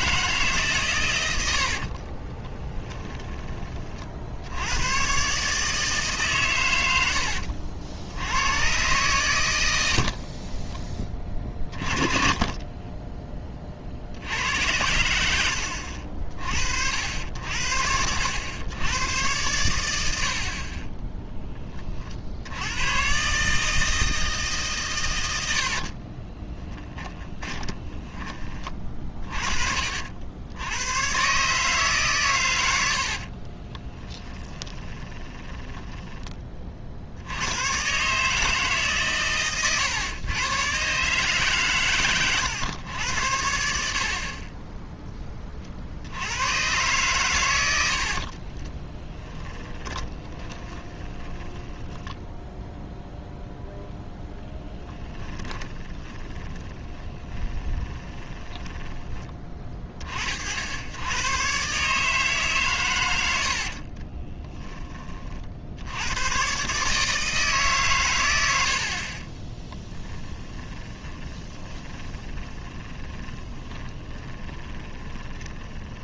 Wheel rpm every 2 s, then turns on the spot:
130, 10, 100, 100, 120, 20, 20, 100, 60, 100, 30, 110, 130, 10, 30, 90, 90, 20, 50, 140, 130, 100, 10, 110, 10, 10, 0, 10, 30, 20, 70, 120, 20, 150, 60, 20, 20, 20.
2-4 10-14 26-28 32-36 48-52 54-60 68-76